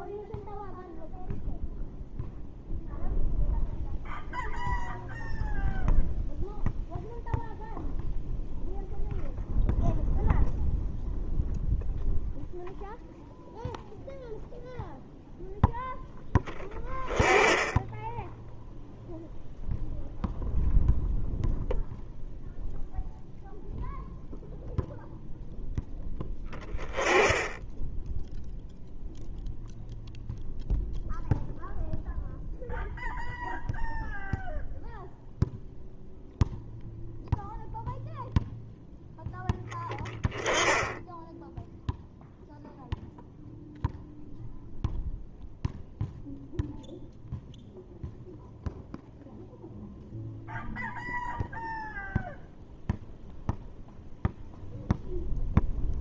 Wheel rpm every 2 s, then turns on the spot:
0, 0, 0, 0, 0, 0, 0, 0, 10, 0, 0, 0, 0, 20, 0, 0, 0, 0, 0, 10, 10, 0, 0, 0, 0, 0, 0, 0.
none